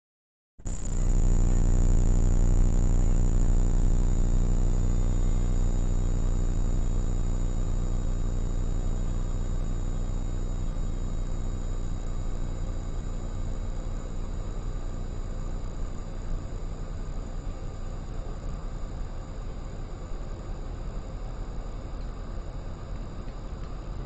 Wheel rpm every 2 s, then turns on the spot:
0, 0, 0, 0, 0, 0, 0, 0, 0, 0, 0, 0.
none